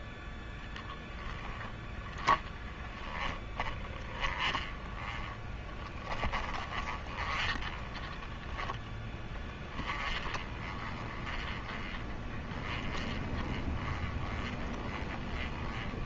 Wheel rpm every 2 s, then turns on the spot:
10, 20, 20, 20, 10, 20, 20, 20.
0-16